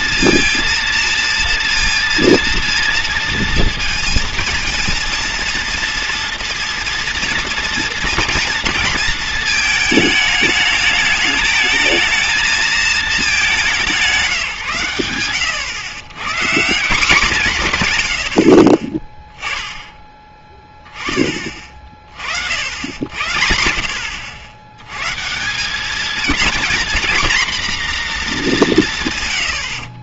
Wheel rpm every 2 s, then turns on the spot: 230, 230, 230, 230, 230, 210, 220, 130, 190, 30, 20, 80, 110, 240, 170.
none